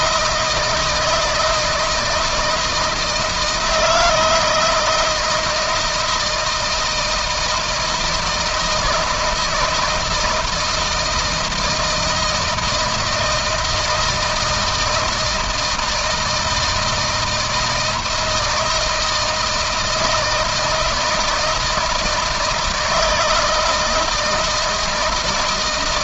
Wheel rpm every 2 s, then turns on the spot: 160, 160, 170, 160, 160, 160, 160, 160, 160, 160, 160, 160, 160.
none